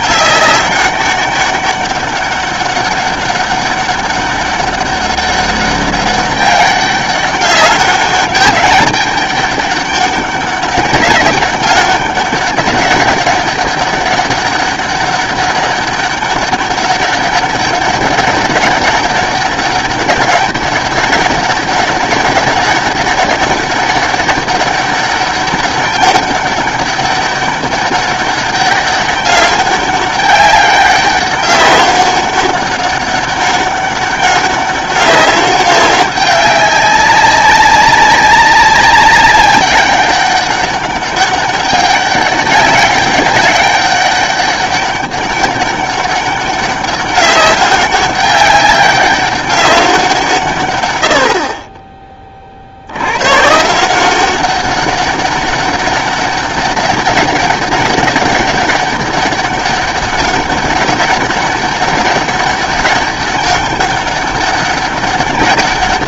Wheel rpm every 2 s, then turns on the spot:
200, 200, 200, 200, 200, 200, 200, 200, 200, 200, 200, 200, 200, 200, 200, 200, 200, 200, 200, 200, 200, 200, 200, 200, 200, 120, 60, 190, 200, 200, 200, 200, 200.
none